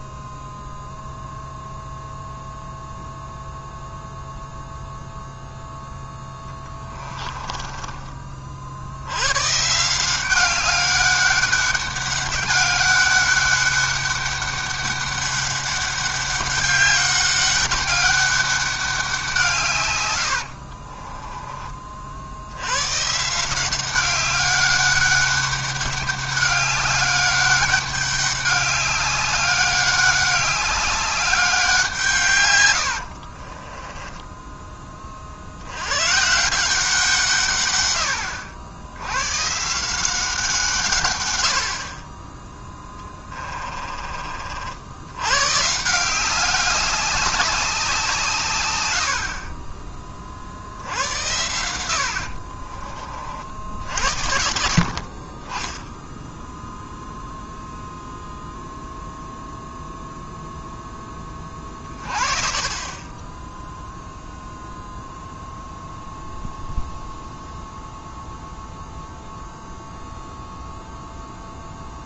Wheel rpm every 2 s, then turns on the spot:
0, 0, 0, 20, 70, 200, 200, 200, 200, 200, 50, 100, 200, 200, 200, 200, 90, 20, 170, 90, 140, 10, 70, 200, 100, 70, 30, 60, 0, 0, 0, 30, 0, 0, 0, 0.
6-8 20-22 32-34 42-44